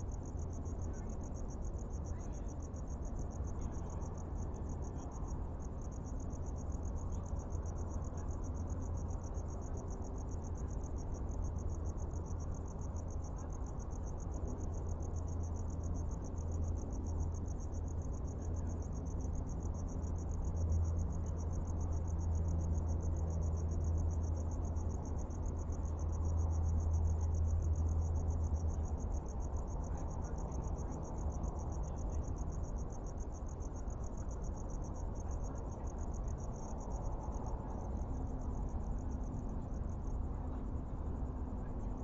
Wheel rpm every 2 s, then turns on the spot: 0, 0, 0, 0, 0, 0, 0, 0, 0, 0, 0, 0, 0, 0, 0, 0, 0, 0, 0, 0, 0.
none